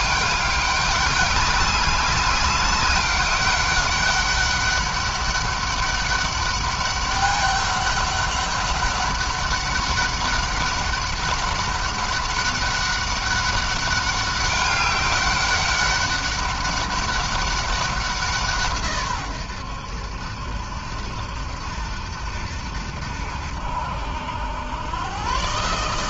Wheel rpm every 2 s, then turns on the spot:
200, 200, 200, 200, 200, 200, 200, 200, 200, 130, 80, 80, 110.
none